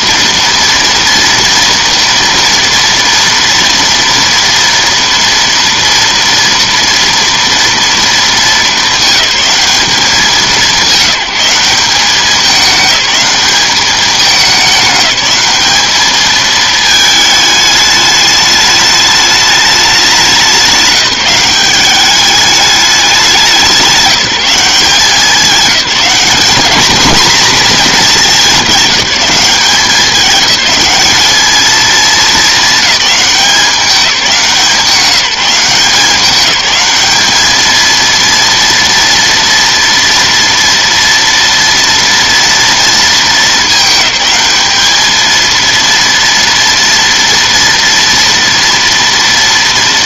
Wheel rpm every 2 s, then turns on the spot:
230, 230, 240, 230, 210, 190, 200, 210, 220, 210, 190, 200, 180, 210, 200, 210, 200, 180, 200, 230, 230, 230, 210, 230, 230.
none